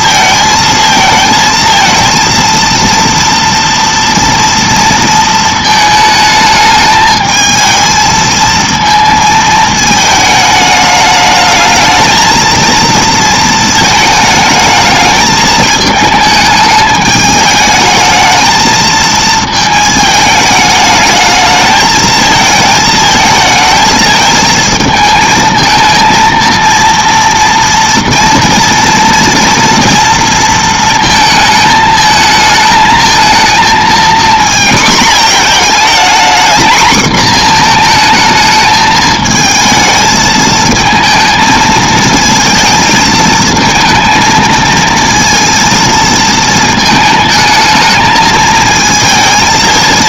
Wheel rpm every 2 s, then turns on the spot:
220, 230, 230, 220, 230, 210, 220, 220, 220, 220, 220, 220, 220, 230, 230, 230, 220, 230, 230, 220, 220, 220, 230, 220, 220.
none